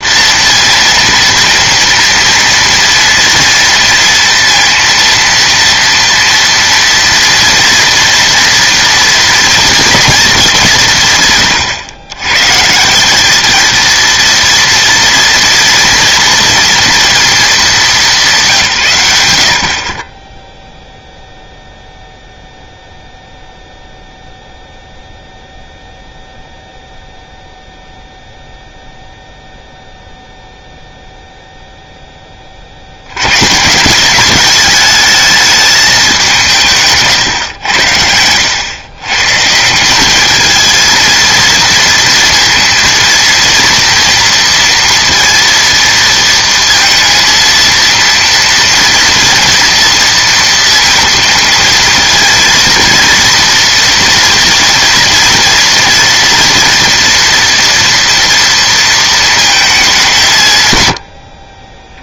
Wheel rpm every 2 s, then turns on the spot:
230, 230, 230, 230, 230, 180, 150, 230, 230, 130, 0, 0, 0, 0, 0, 0, 50, 210, 160, 110, 220, 230, 230, 230, 230, 230, 230, 230, 230, 230, 110.
36-38